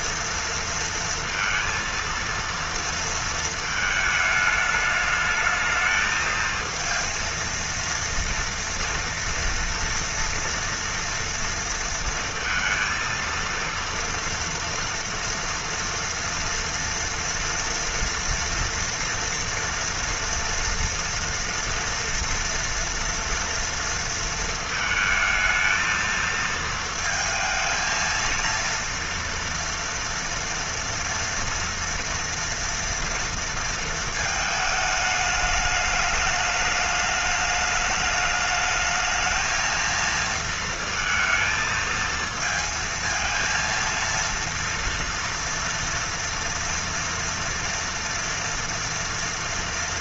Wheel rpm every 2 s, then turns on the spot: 230, 230, 210, 220, 230, 230, 230, 230, 230, 230, 230, 230, 220, 220, 230, 230, 230, 220, 210, 210, 230, 230, 230, 230, 240.
none